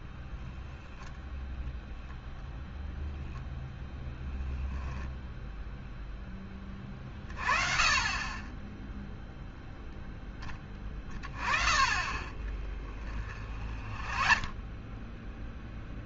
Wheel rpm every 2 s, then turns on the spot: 20, 0, 10, 10, 20, 20, 20, 20.
12-16